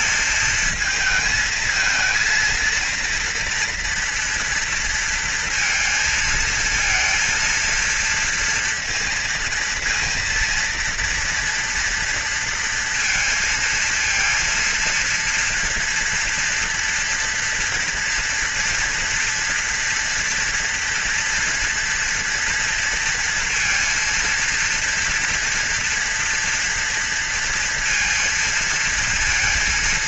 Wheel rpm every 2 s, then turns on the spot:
230, 230, 230, 220, 230, 230, 230, 230, 240, 240, 230, 240, 230, 230, 230.
none